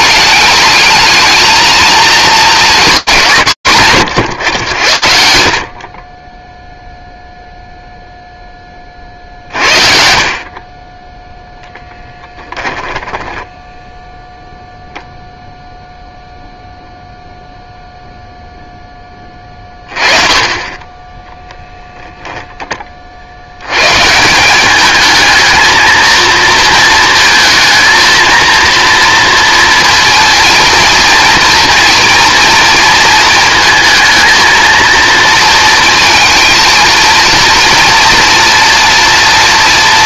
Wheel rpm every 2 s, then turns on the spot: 220, 180, 80, 0, 50, 10, 10, 0, 0, 10, 10, 60, 220, 230, 230, 230, 220, 230, 230, 230.
12-14